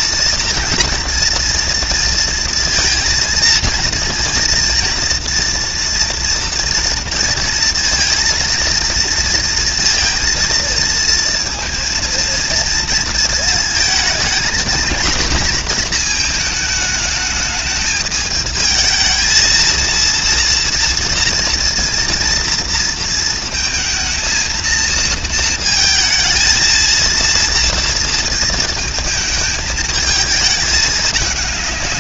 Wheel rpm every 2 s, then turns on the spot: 230, 230, 230, 230, 230, 230, 230, 230, 220, 220, 230, 230, 220, 230, 230, 210.
none